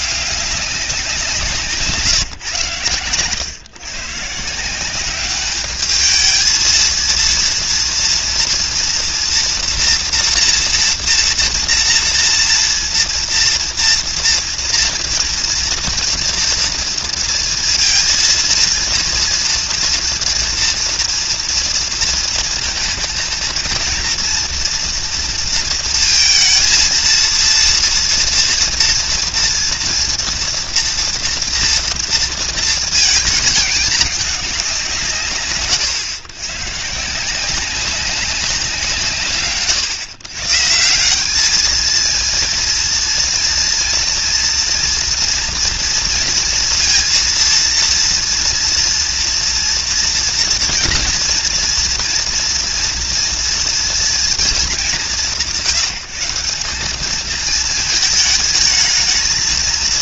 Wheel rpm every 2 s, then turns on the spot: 190, 130, 160, 220, 230, 230, 230, 230, 230, 230, 230, 230, 230, 230, 230, 240, 230, 160, 130, 180, 140, 230, 230, 230, 230, 230, 230, 190, 190, 210.
2-4